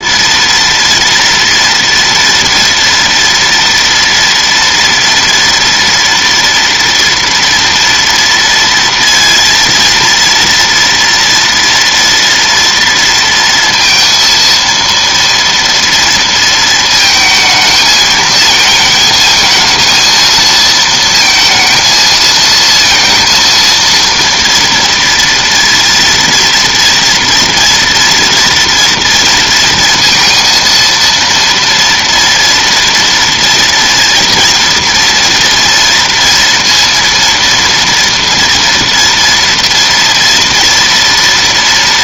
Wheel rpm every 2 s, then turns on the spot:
230, 230, 230, 230, 230, 230, 230, 230, 230, 220, 230, 230, 230, 230, 230, 230, 230, 230, 230, 230, 240.
none